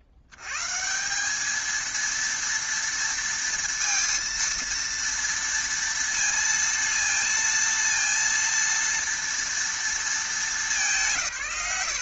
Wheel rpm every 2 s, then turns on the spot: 80, 230, 230, 230, 230, 220.
none